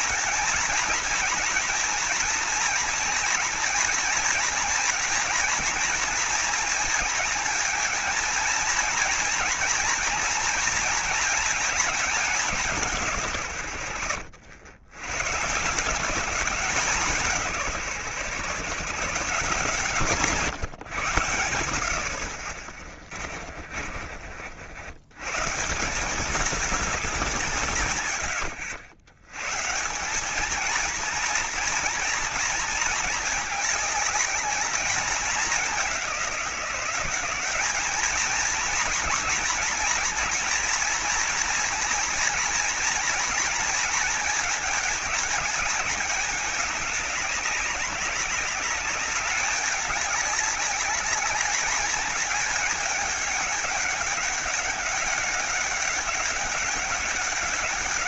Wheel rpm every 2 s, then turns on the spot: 220, 240, 230, 230, 230, 230, 160, 110, 180, 160, 110, 30, 100, 190, 100, 230, 220, 210, 190, 230, 230, 230, 220, 200, 200, 200, 200, 200, 200.
22-24